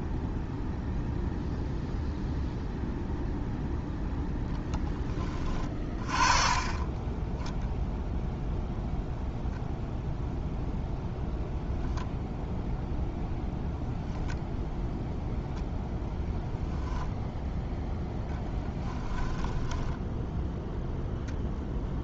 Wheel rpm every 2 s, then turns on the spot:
0, 0, 10, 20, 0, 0, 0, 0, 0, 10, 0.
18-20